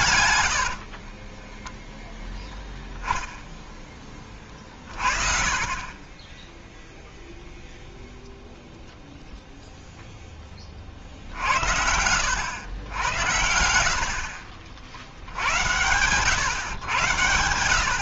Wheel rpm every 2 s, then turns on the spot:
80, 10, 30, 10, 0, 30, 90, 70, 110.
0-2